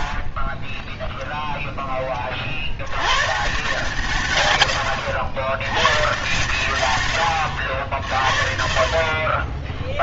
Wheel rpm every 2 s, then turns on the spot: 0, 100, 100, 130, 50.
8-10